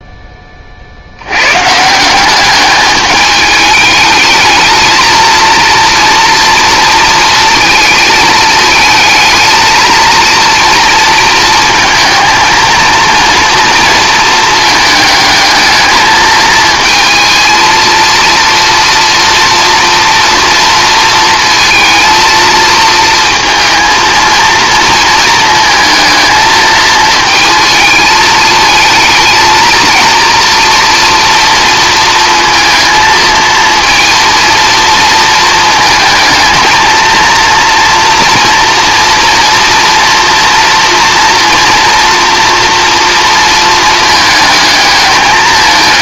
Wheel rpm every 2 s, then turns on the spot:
50, 210, 220, 230, 220, 230, 230, 220, 220, 230, 230, 230, 230, 220, 220, 230, 230, 230, 230, 240, 230, 240, 210.
none